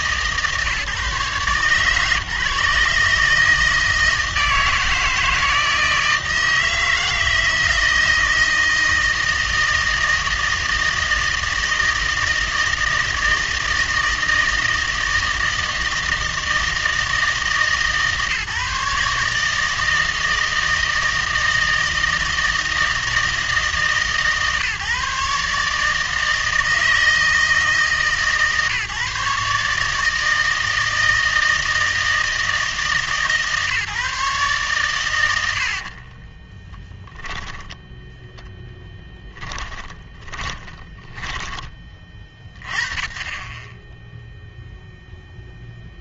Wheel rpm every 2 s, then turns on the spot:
140, 140, 160, 160, 160, 160, 160, 160, 160, 150, 160, 160, 140, 160, 140, 160, 160, 130, 20, 10, 10, 30, 0.
36-42